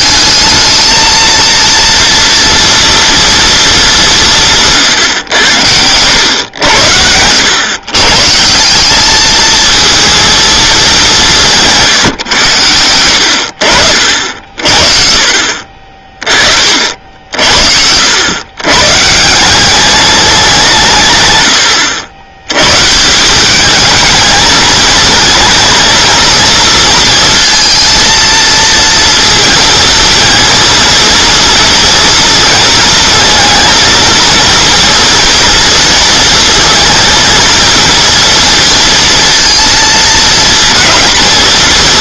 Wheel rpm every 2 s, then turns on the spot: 220, 240, 150, 90, 180, 220, 90, 50, 50, 120, 170, 120, 220, 230, 230, 230, 220, 230, 230, 230, 220.
16-18